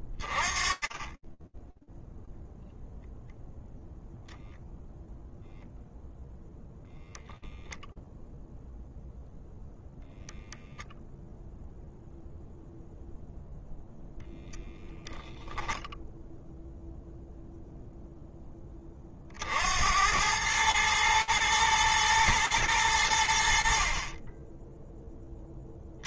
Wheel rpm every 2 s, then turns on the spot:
20, 0, 0, 0, 0, 0, 0, 0, 10, 100, 110, 20, 70.
none